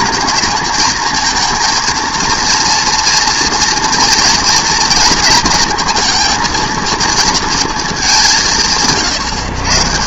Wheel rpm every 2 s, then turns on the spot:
230, 230, 230, 230, 150.
none